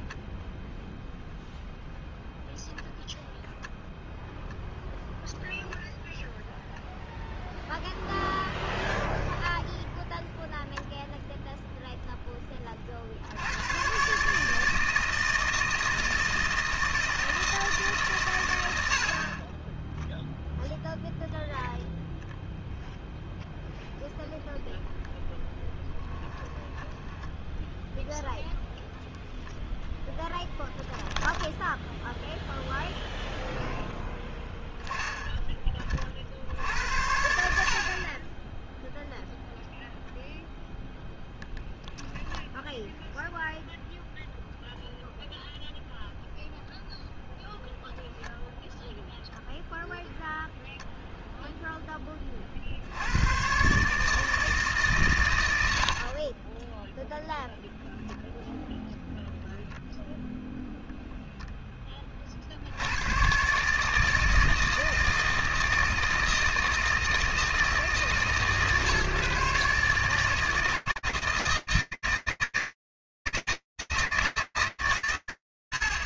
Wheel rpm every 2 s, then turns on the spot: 0, 0, 0, 0, 10, 0, 20, 150, 160, 90, 0, 0, 0, 10, 0, 0, 0, 10, 60, 10, 0, 0, 0, 0, 0, 0, 50, 150, 20, 0, 0, 70, 160, 160, 140, 160, 160, 160.
26-28